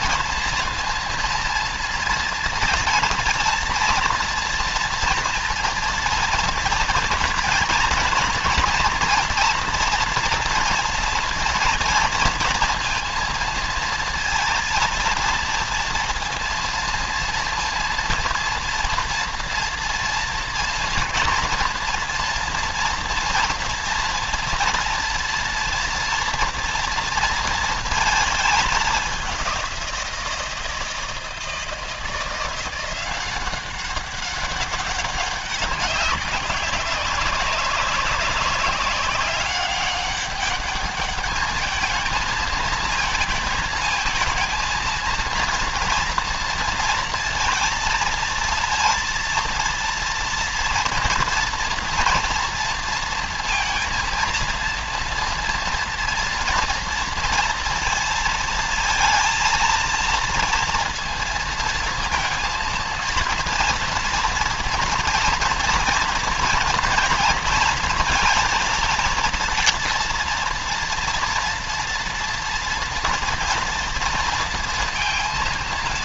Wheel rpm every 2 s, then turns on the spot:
230, 230, 230, 230, 230, 230, 230, 230, 230, 230, 230, 230, 230, 230, 210, 170, 180, 200, 190, 190, 200, 220, 230, 230, 230, 230, 230, 230, 230, 230, 230, 230, 230, 230, 230, 240, 230, 230.
none